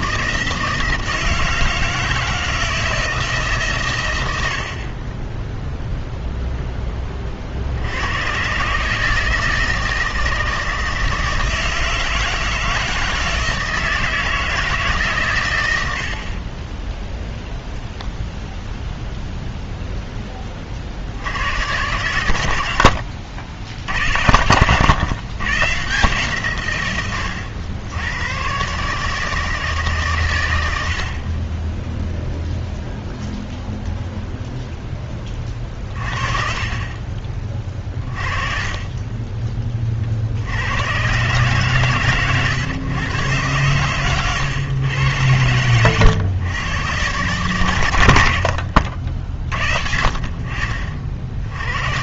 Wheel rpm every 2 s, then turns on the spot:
160, 160, 70, 0, 140, 160, 160, 160, 20, 10, 40, 90, 100, 140, 120, 90, 0, 0, 40, 30, 90, 120, 120, 100, 80, 50.
30-32 38-40